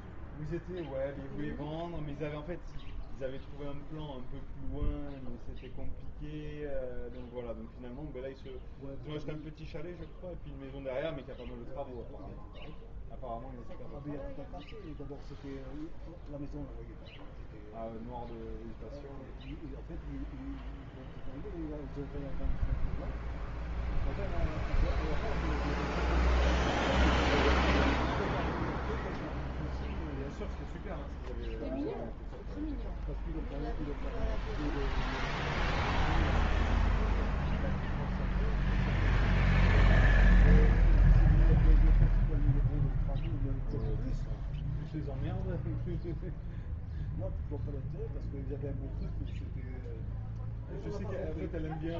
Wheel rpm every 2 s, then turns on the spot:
0, 0, 0, 0, 0, 0, 0, 0, 0, 0, 0, 0, 0, 0, 0, 0, 0, 0, 0, 0, 0, 0, 0, 0, 0, 0.
none